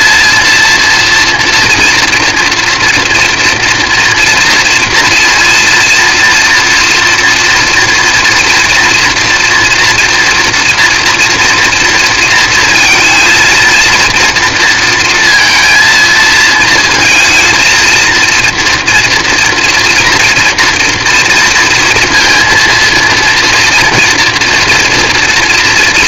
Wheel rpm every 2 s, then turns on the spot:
230, 230, 230, 230, 240, 230, 230, 230, 230, 230, 230, 230, 230.
none